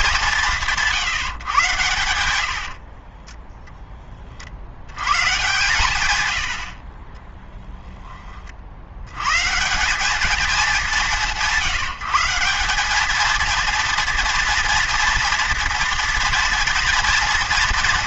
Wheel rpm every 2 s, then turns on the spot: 160, 60, 50, 70, 60, 210, 190, 230, 230.
2-4 6-8